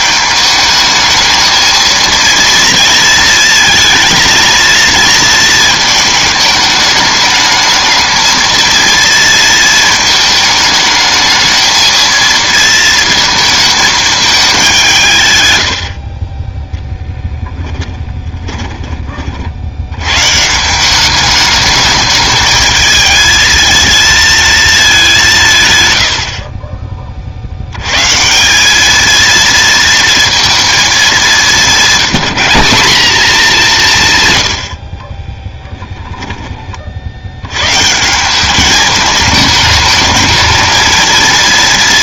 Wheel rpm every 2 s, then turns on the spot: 220, 230, 230, 210, 230, 220, 230, 150, 10, 40, 190, 220, 220, 30, 200, 220, 200, 60, 30, 210, 220.
18-20